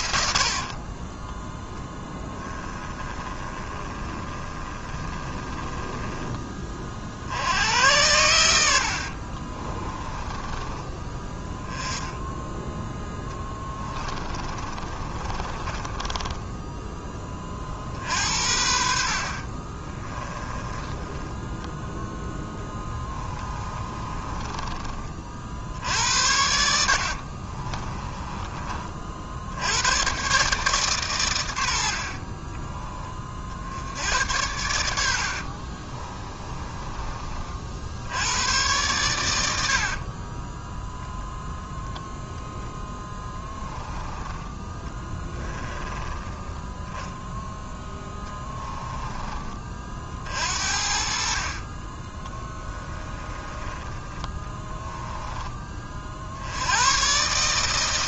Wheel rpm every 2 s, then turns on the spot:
30, 20, 20, 40, 60, 20, 10, 30, 20, 60, 10, 10, 30, 60, 50, 130, 20, 70, 20, 110, 0, 10, 20, 10, 20, 50, 20, 10, 110.
0-6 8-10 14-16 20-24 26-28 44-46 48-56